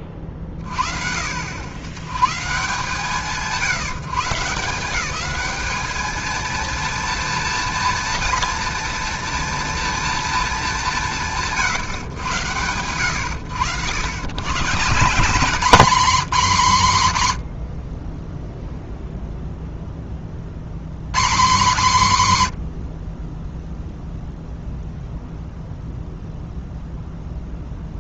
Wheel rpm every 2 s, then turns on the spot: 40, 140, 180, 230, 230, 220, 100, 150, 160, 0, 50, 70, 0, 0.
none